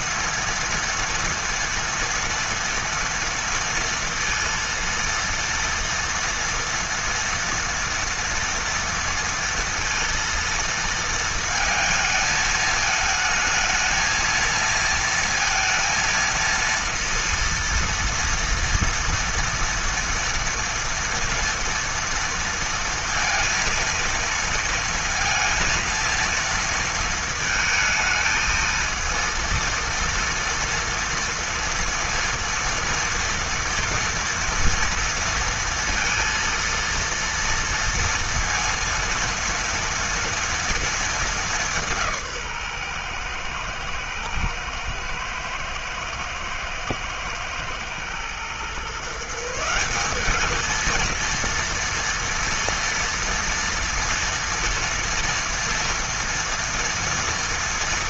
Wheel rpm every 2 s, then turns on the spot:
230, 230, 230, 230, 230, 230, 220, 230, 230, 230, 240, 230, 230, 230, 220, 230, 230, 230, 230, 230, 230, 130, 120, 110, 130, 220, 230, 230, 230.
none